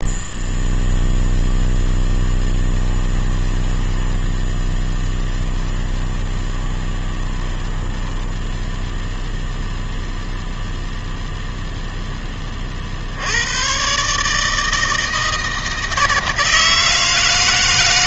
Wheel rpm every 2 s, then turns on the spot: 0, 10, 10, 20, 0, 0, 40, 160, 160.
2-8